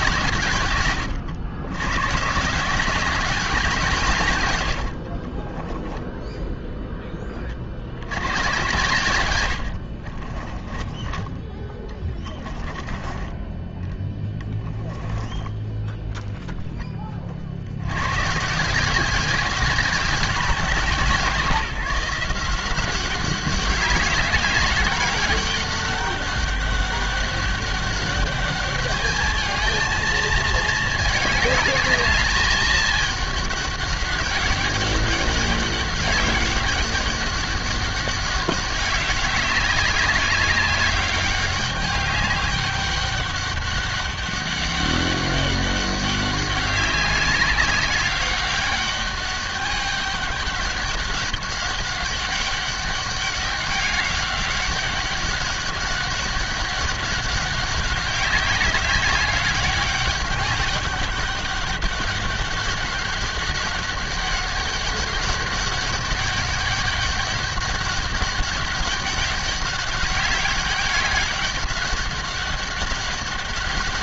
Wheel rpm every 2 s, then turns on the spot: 130, 180, 80, 0, 110, 20, 20, 10, 10, 170, 180, 180, 200, 200, 210, 220, 210, 200, 200, 200, 190, 200, 200, 190, 200, 200, 200, 200, 200, 190, 200, 200, 200, 200, 200, 200, 190.
10-12 14-16